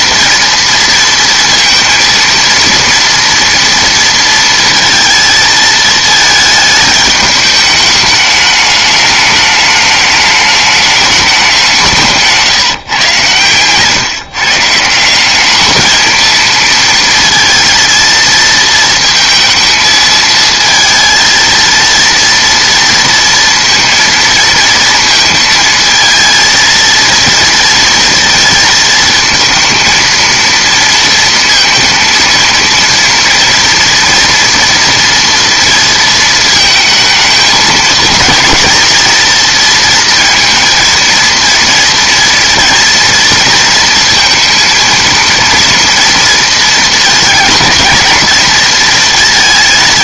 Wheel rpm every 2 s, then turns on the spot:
230, 230, 230, 220, 210, 210, 150, 140, 230, 230, 230, 230, 230, 230, 230, 230, 230, 230, 220, 230, 230, 230, 230, 230, 230.
none